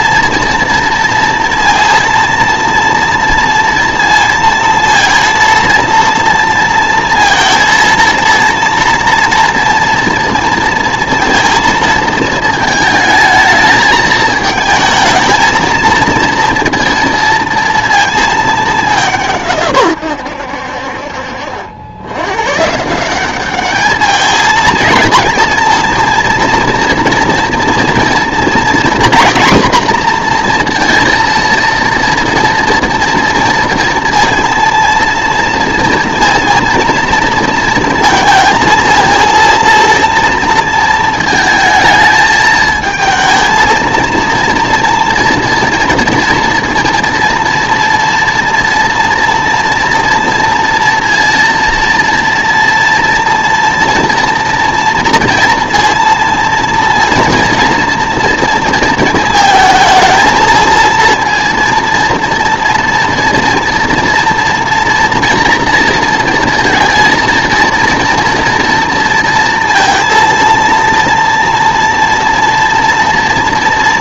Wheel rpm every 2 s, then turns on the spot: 230, 230, 230, 230, 230, 230, 220, 220, 230, 190, 60, 150, 230, 230, 240, 230, 230, 230, 230, 230, 220, 220, 230, 230, 240, 230, 230, 230, 230, 220, 230, 230, 230, 230, 230, 230, 230.
none